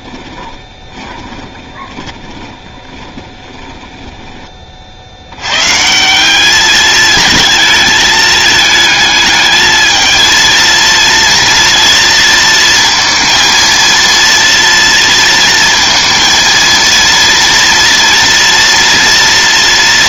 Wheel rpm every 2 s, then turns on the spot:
20, 20, 70, 220, 220, 230, 230, 230, 230, 230.
0-4